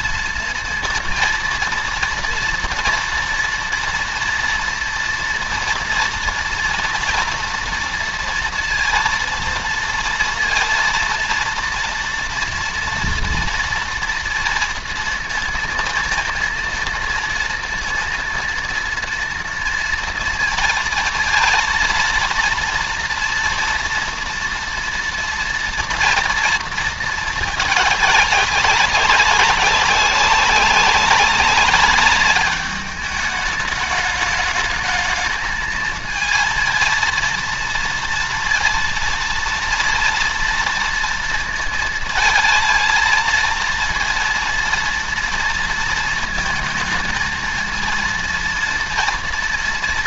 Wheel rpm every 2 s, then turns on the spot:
230, 230, 230, 240, 230, 230, 230, 230, 230, 230, 230, 230, 240, 220, 200, 200, 210, 210, 230, 230, 230, 230, 230, 220, 230.
none